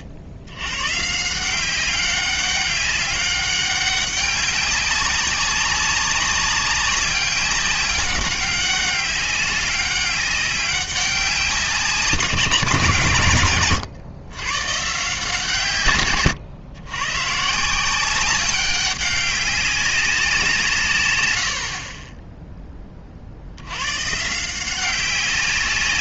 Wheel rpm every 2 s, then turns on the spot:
100, 200, 200, 200, 200, 200, 170, 130, 120, 190, 160, 10, 170.
none